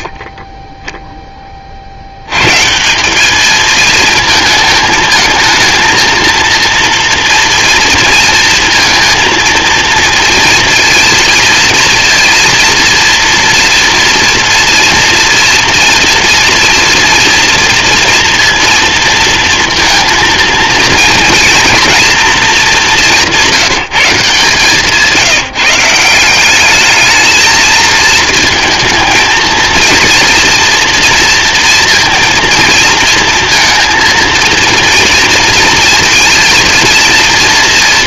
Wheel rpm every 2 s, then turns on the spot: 10, 170, 220, 230, 230, 230, 230, 230, 230, 230, 230, 200, 160, 210, 230, 230, 230, 230, 230.
none